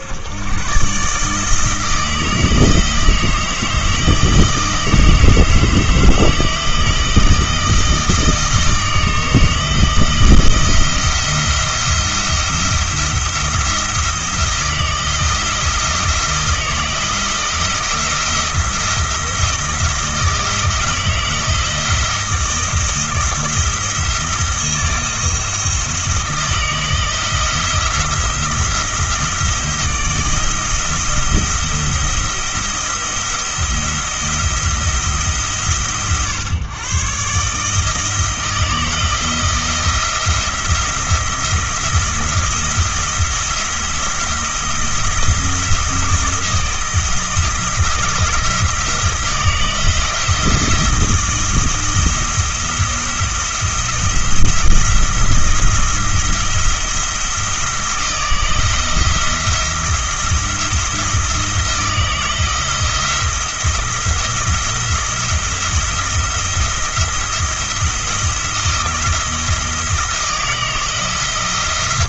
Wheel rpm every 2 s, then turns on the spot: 130, 160, 160, 160, 160, 170, 170, 170, 160, 170, 160, 170, 170, 160, 160, 170, 170, 170, 130, 160, 170, 170, 170, 170, 160, 160, 170, 160, 170, 170, 170, 170, 170, 170, 170, 160.
none